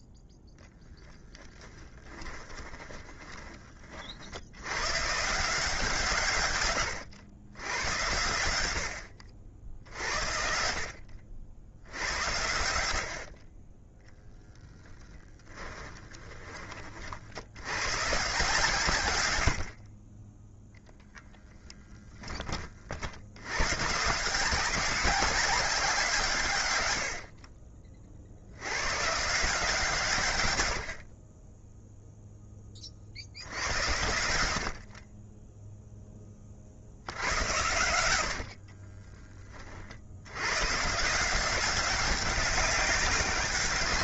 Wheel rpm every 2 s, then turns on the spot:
0, 20, 110, 120, 80, 60, 70, 10, 40, 120, 0, 50, 190, 100, 110, 70, 40, 40, 70, 30, 150, 200.
2-4 14-16 38-40